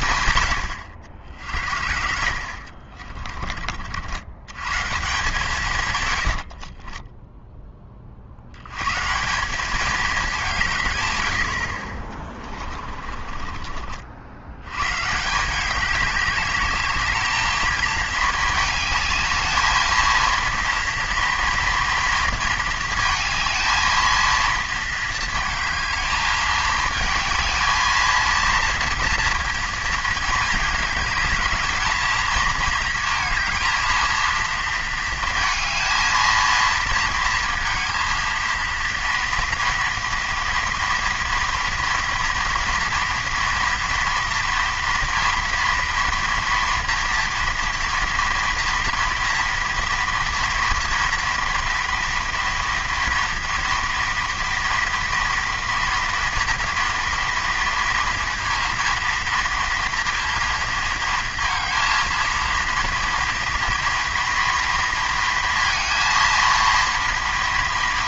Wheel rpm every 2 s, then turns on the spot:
70, 40, 150, 10, 170, 100, 30, 160, 220, 210, 230, 220, 230, 220, 230, 220, 230, 220, 230, 230, 230, 230, 240, 230, 240, 230, 230, 230, 230, 230, 230, 230, 230, 230.
12-14